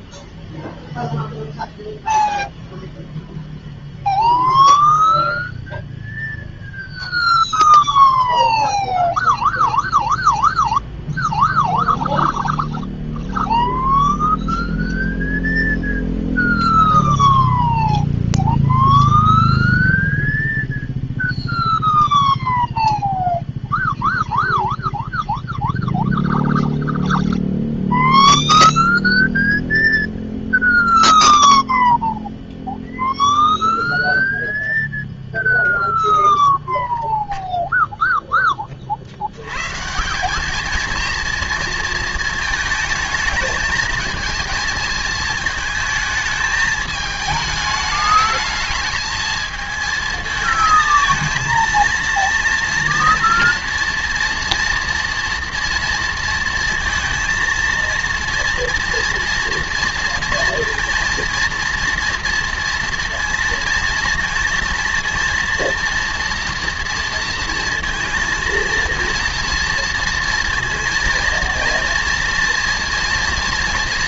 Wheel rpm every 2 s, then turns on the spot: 0, 0, 0, 0, 0, 0, 0, 0, 0, 0, 0, 0, 0, 0, 0, 0, 0, 0, 0, 10, 210, 220, 230, 220, 210, 220, 230, 230, 230, 230, 230, 230, 230, 240, 230, 230, 230.
none